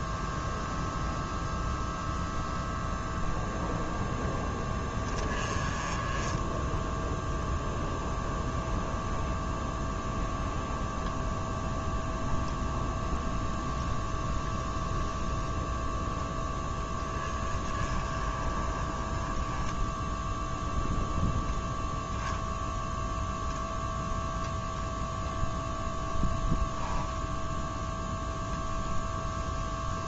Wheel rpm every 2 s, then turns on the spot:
0, 0, 20, 0, 0, 0, 0, 0, 10, 20, 0, 0, 0, 0, 0.
none